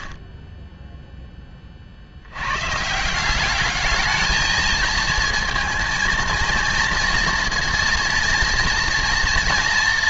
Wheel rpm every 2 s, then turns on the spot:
10, 130, 220, 230, 230.
none